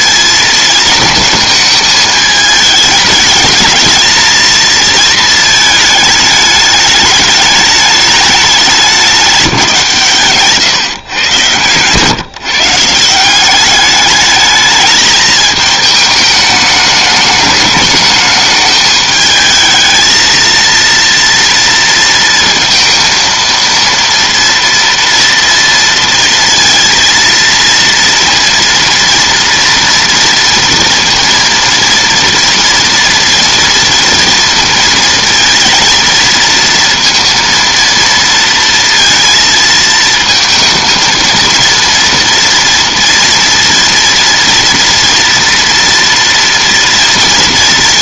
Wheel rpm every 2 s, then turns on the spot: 230, 220, 230, 210, 200, 140, 160, 220, 210, 210, 230, 230, 230, 230, 230, 230, 230, 230, 230, 230, 230, 230, 230, 230.
none